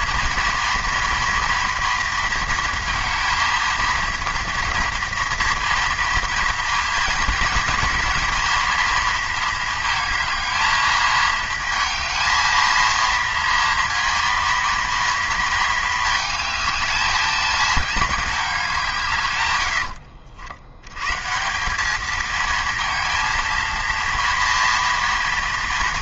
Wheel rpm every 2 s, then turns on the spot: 230, 230, 230, 230, 230, 220, 230, 230, 220, 140, 140, 230, 230.
none